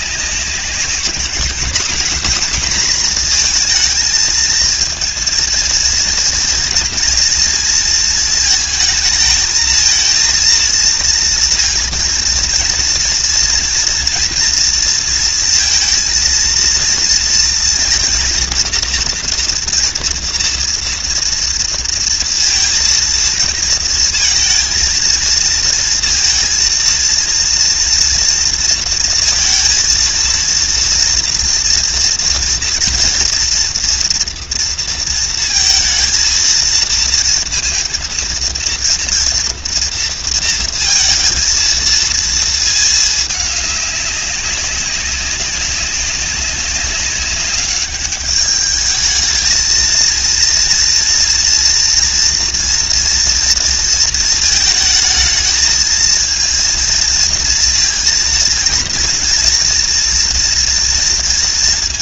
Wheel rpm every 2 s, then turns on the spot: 200, 230, 220, 230, 220, 230, 230, 230, 230, 240, 230, 230, 230, 230, 230, 230, 230, 230, 230, 230, 230, 220, 200, 200, 220, 230, 230, 220, 230, 230, 230.
none